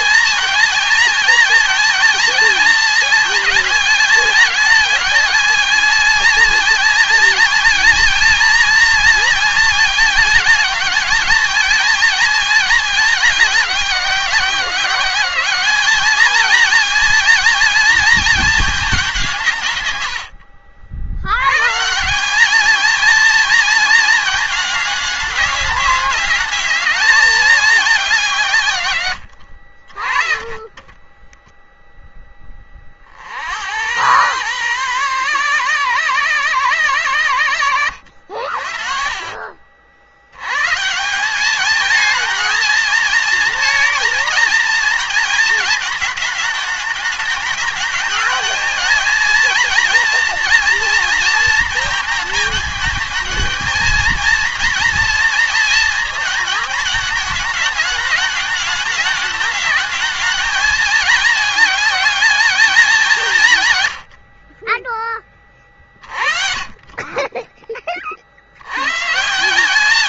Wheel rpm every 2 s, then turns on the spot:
230, 220, 220, 220, 230, 220, 220, 190, 220, 220, 90, 210, 220, 210, 180, 40, 10, 110, 120, 70, 110, 230, 230, 210, 220, 230, 220, 230, 220, 210, 210, 220, 50, 30, 70.
20-22 30-32